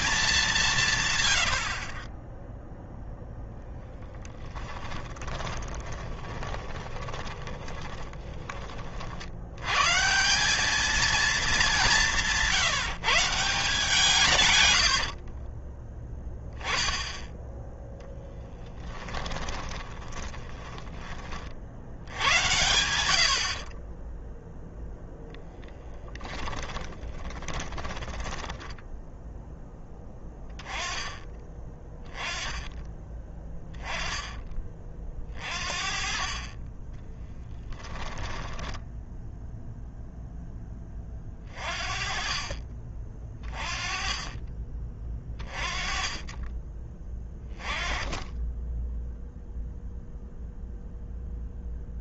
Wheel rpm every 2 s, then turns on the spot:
130, 0, 20, 20, 50, 220, 170, 80, 10, 20, 20, 90, 0, 30, 20, 20, 10, 30, 10, 10, 20, 30, 30, 20, 10, 0.
0-2 4-8 14-16 18-20 26-30 36-38